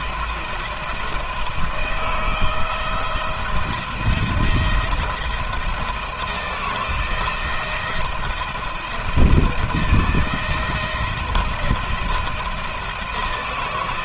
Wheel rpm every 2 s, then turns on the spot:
170, 170, 170, 160, 170, 170, 170.
none